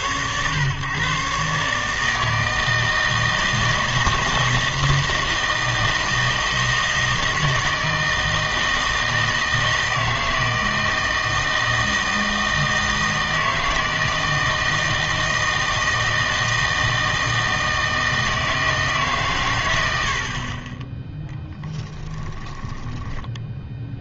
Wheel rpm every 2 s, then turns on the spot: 130, 160, 160, 160, 160, 160, 160, 160, 160, 160, 20, 10.
22-24